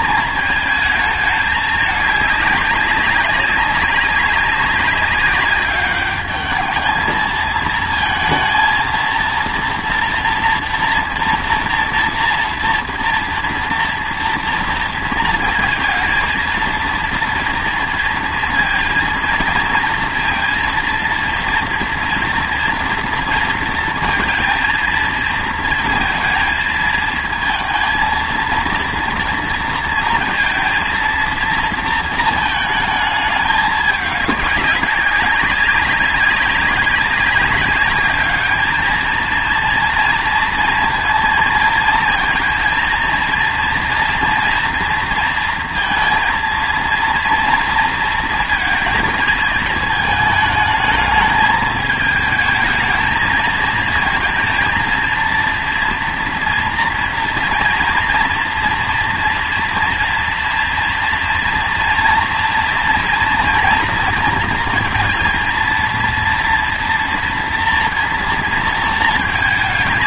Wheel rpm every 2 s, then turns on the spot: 220, 200, 200, 210, 220, 230, 230, 230, 230, 230, 230, 230, 230, 220, 230, 230, 220, 200, 200, 210, 230, 230, 230, 230, 230, 220, 220, 230, 230, 240, 230, 230, 230, 230, 230.
none